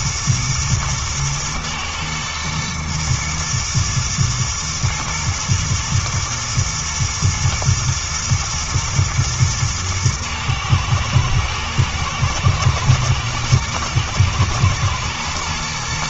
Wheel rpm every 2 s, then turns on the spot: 110, 110, 110, 120, 120, 110, 110, 120.
none